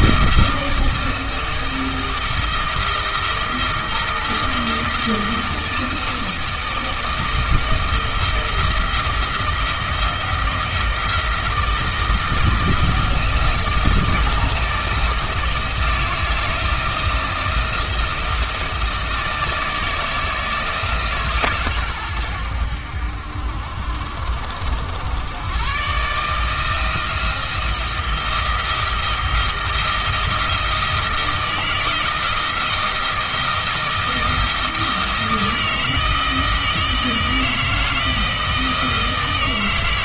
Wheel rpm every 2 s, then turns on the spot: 160, 170, 170, 160, 170, 160, 170, 160, 160, 160, 160, 80, 80, 160, 160, 160, 160, 160, 160, 160.
none